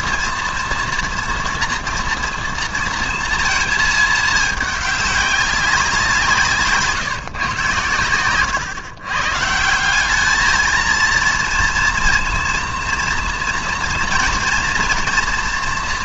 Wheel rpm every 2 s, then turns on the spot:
230, 230, 210, 150, 120, 230, 230, 230.
none